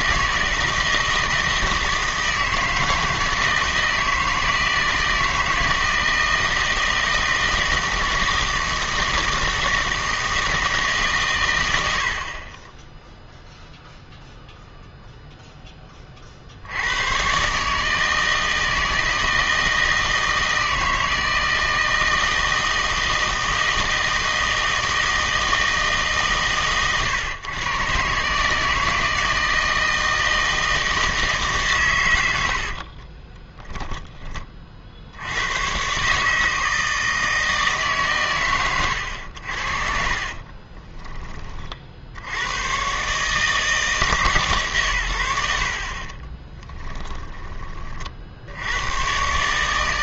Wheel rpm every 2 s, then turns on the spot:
160, 160, 160, 160, 160, 150, 10, 0, 80, 160, 160, 160, 160, 130, 160, 160, 50, 50, 160, 110, 30, 120, 120, 10, 90.
32-34 40-42 46-48